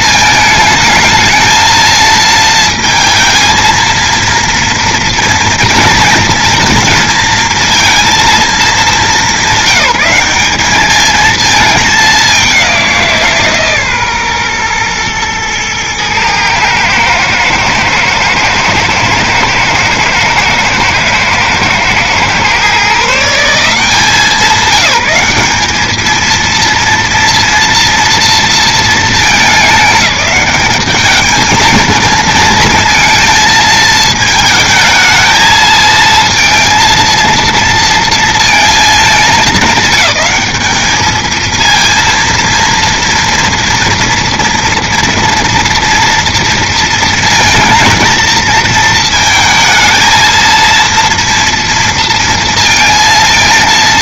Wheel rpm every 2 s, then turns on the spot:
220, 230, 230, 220, 230, 200, 200, 130, 110, 110, 110, 110, 180, 220, 240, 190, 230, 220, 220, 230, 210, 230, 230, 230, 230, 220, 230.
none